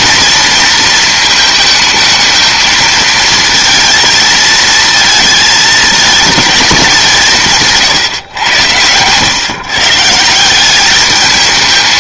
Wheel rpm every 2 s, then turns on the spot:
230, 220, 220, 210, 120, 180.
none